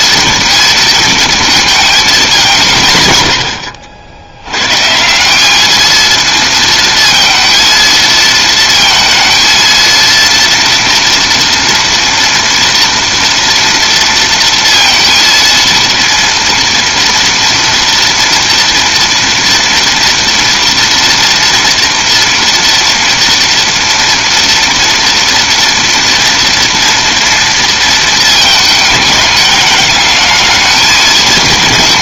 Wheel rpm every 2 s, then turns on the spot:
230, 190, 110, 230, 220, 230, 230, 230, 230, 230, 230, 230, 230, 230, 220, 220.
none